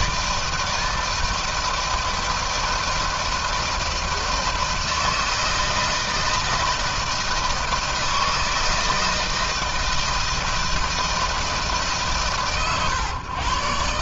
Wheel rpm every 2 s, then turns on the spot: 160, 160, 160, 160, 160, 160, 130.
none